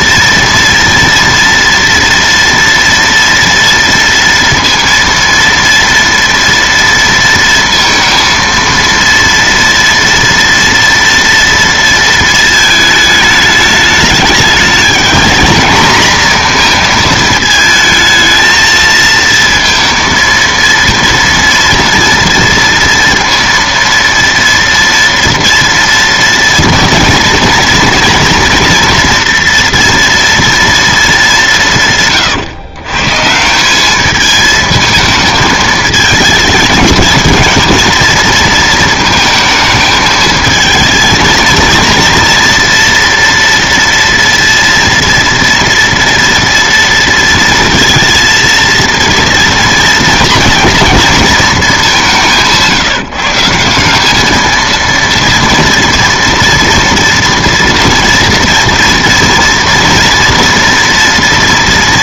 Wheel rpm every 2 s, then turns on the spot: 230, 230, 230, 230, 230, 230, 220, 210, 230, 220, 230, 230, 230, 230, 230, 230, 130, 220, 220, 230, 220, 240, 230, 230, 230, 230, 170, 230, 230, 240, 230.
none